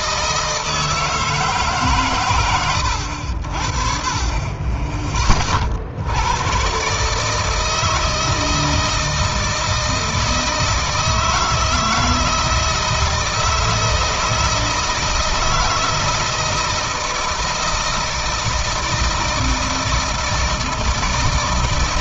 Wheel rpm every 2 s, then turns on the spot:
160, 80, 20, 140, 160, 160, 160, 160, 160, 160, 160.
none